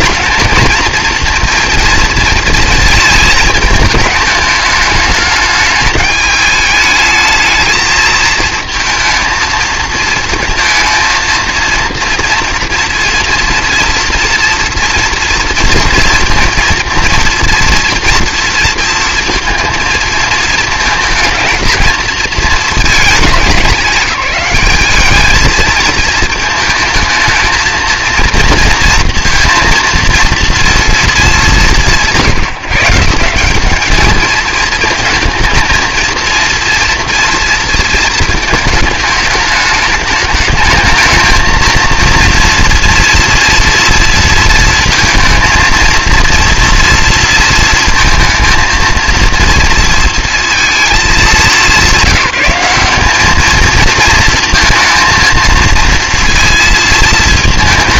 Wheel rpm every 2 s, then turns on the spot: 220, 230, 210, 210, 220, 230, 230, 230, 230, 230, 220, 220, 200, 220, 230, 230, 160, 220, 230, 220, 210, 230, 230, 230, 220, 220, 190, 230, 230.
none